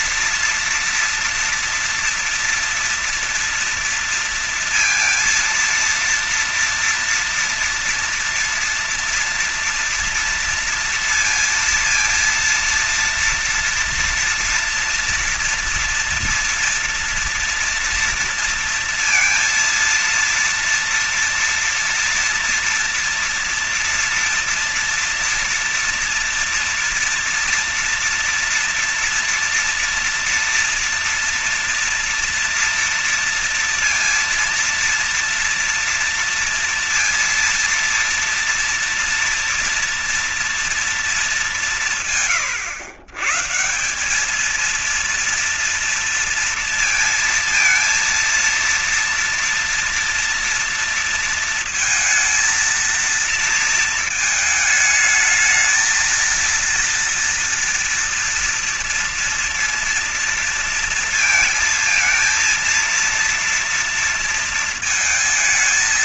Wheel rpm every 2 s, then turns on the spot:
230, 230, 230, 230, 230, 230, 230, 230, 230, 230, 230, 230, 230, 230, 230, 230, 230, 230, 230, 230, 240, 120, 200, 230, 230, 230, 230, 220, 230, 230, 230, 230, 230.
none